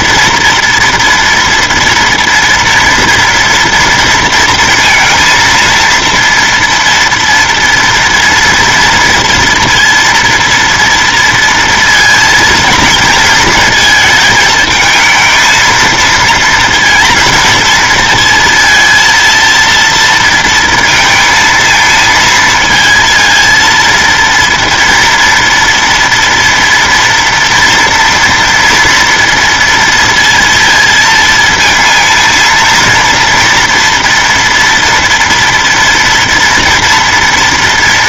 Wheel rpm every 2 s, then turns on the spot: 230, 240, 230, 230, 230, 230, 230, 220, 230, 230, 230, 230, 230, 230, 230, 230, 230, 230, 230.
none